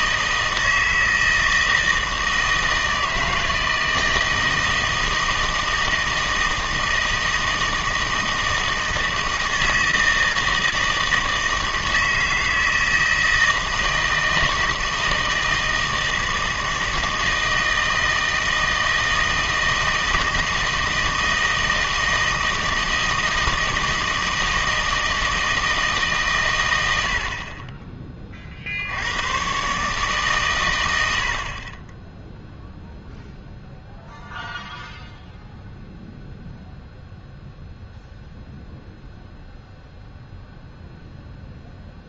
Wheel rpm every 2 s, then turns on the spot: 160, 160, 160, 160, 160, 160, 160, 160, 160, 160, 160, 160, 160, 100, 50, 110, 0, 0, 0, 0, 0.
none